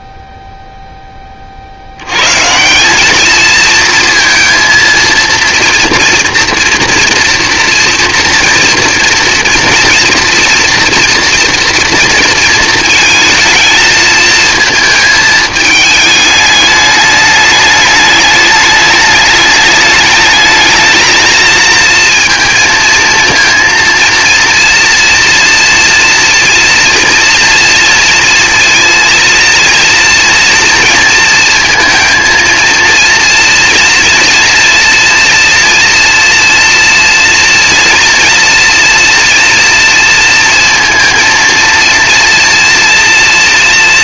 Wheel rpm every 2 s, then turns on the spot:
0, 60, 220, 230, 230, 230, 230, 220, 210, 210, 210, 230, 230, 240, 230, 230, 230, 230, 230, 230, 230, 230.
none